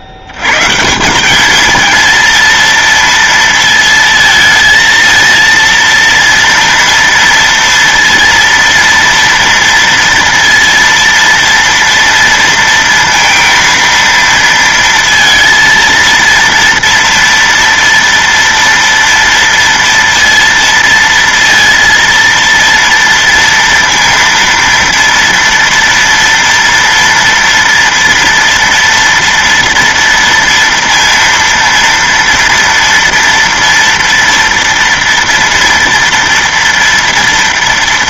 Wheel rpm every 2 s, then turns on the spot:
80, 230, 230, 230, 230, 230, 230, 230, 230, 230, 230, 230, 230, 230, 230, 230, 230, 230, 230.
none